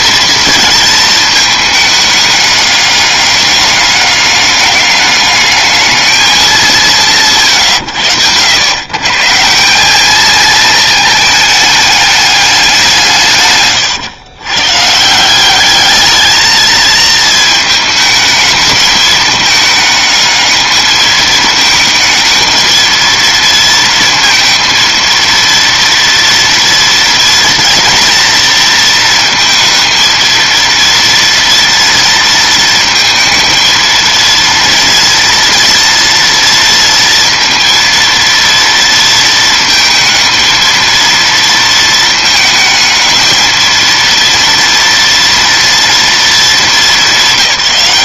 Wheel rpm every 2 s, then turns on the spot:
220, 200, 200, 160, 120, 220, 170, 150, 220, 210, 220, 220, 230, 230, 230, 230, 220, 230, 230, 230, 230, 220, 230, 210.
none